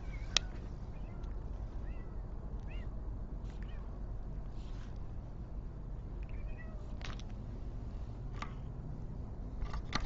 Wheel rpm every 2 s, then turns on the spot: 0, 0, 0, 0, 0.
none